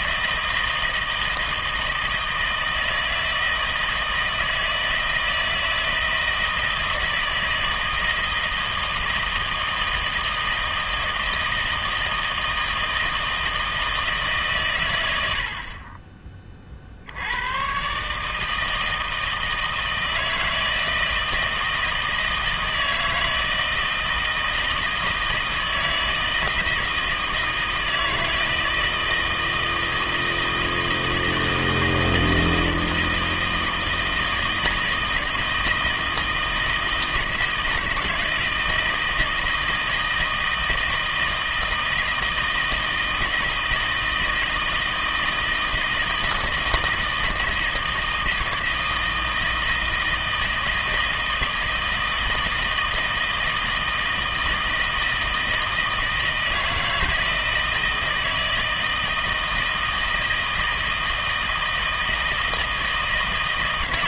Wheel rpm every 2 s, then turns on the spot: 160, 160, 160, 160, 160, 160, 160, 130, 40, 160, 160, 160, 160, 160, 160, 160, 160, 160, 160, 160, 160, 160, 160, 160, 160, 160, 160, 160, 160, 160, 160, 160.
none